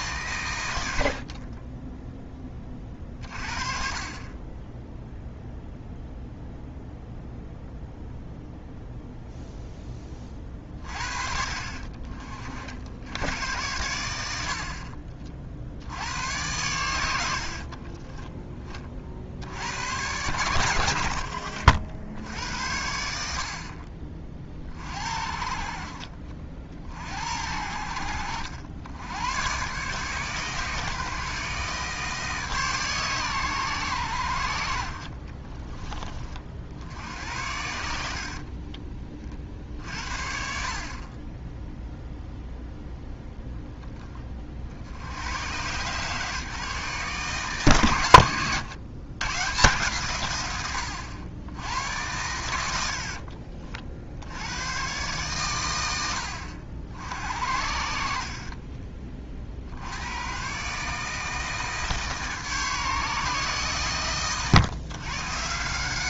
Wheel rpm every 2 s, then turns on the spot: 110, 20, 20, 0, 0, 40, 60, 60, 90, 20, 90, 70, 40, 50, 80, 140, 150, 70, 50, 30, 70, 0, 50, 150, 120, 110, 90, 100, 70, 40, 130, 150, 130.
38-40